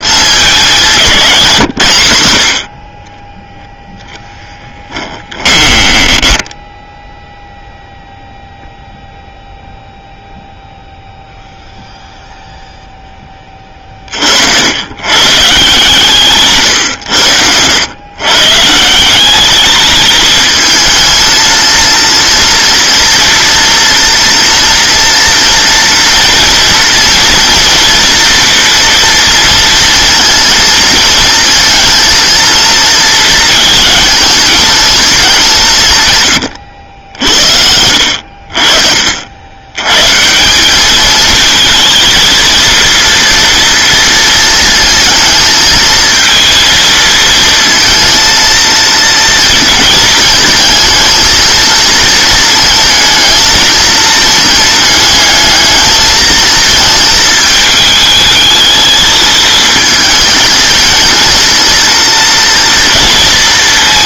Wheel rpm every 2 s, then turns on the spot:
200, 60, 10, 10, 0, 0, 0, 70, 130, 140, 220, 230, 240, 230, 240, 220, 230, 220, 90, 50, 190, 230, 230, 230, 230, 220, 220, 220, 220, 220, 220, 230.
4-8